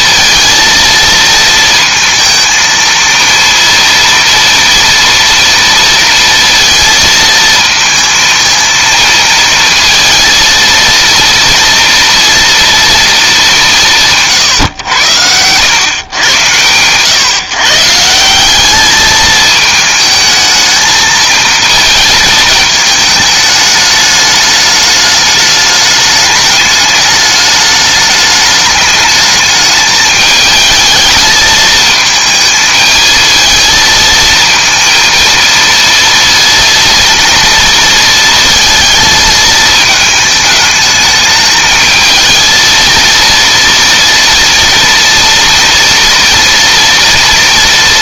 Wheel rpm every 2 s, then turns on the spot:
230, 230, 230, 230, 230, 230, 230, 110, 130, 210, 220, 220, 210, 210, 210, 220, 220, 230, 230, 230, 220, 230, 230, 230.
none